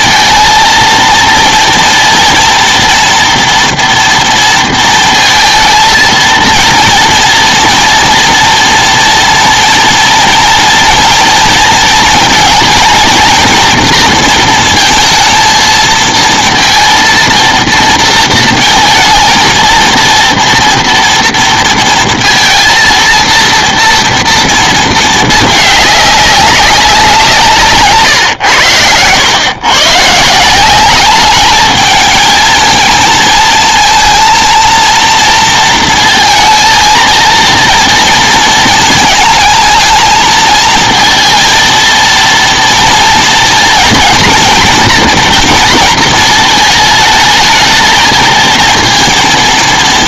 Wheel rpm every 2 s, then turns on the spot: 230, 230, 230, 230, 240, 230, 230, 230, 230, 230, 230, 230, 230, 200, 130, 150, 220, 230, 230, 230, 220, 230, 230, 230, 220.
none